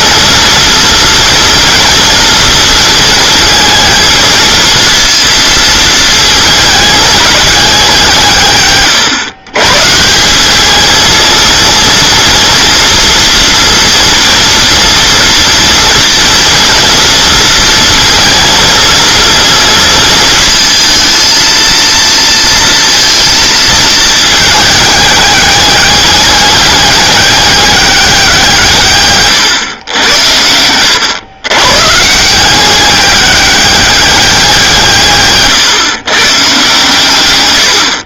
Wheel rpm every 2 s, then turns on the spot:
230, 230, 230, 220, 140, 220, 240, 230, 230, 230, 230, 230, 210, 200, 150, 100, 190, 170, 140.
none